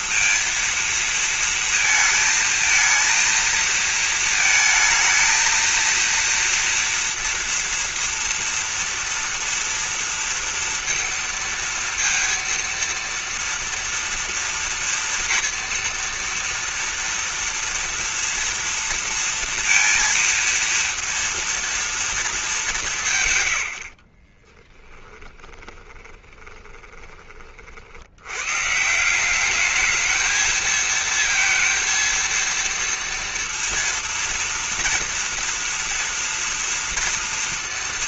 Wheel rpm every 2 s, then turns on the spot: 230, 230, 220, 230, 230, 230, 230, 230, 230, 230, 230, 170, 10, 20, 140, 220, 230, 230, 230.
24-28